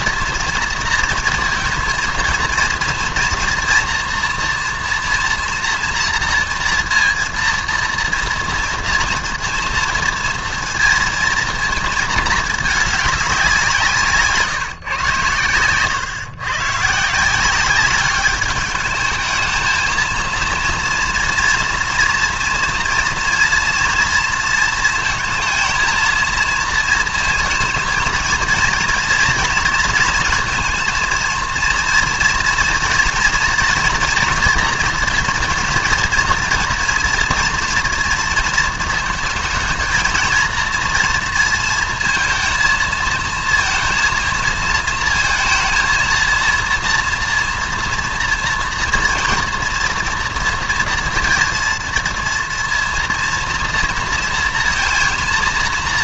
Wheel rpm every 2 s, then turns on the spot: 230, 230, 230, 230, 230, 230, 210, 140, 130, 200, 230, 230, 230, 220, 230, 230, 230, 230, 230, 230, 230, 220, 230, 230, 240, 230, 230, 230.
none